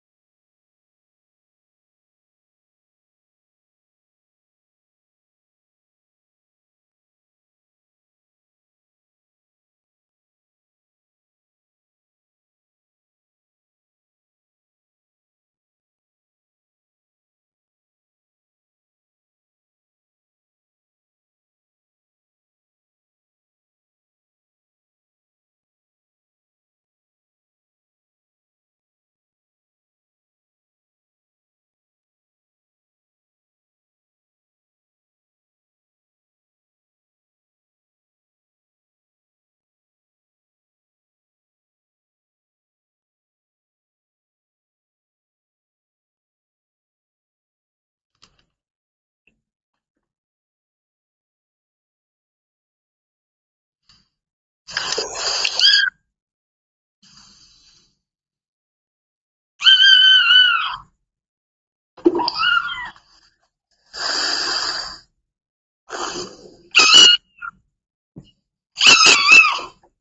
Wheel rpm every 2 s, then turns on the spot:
0, 0, 0, 0, 0, 0, 0, 0, 0, 0, 0, 0, 0, 0, 0, 0, 0, 0, 0, 0, 0, 0, 0, 0, 0, 0, 0, 0, 0, 0, 0, 0, 0, 0, 0.
none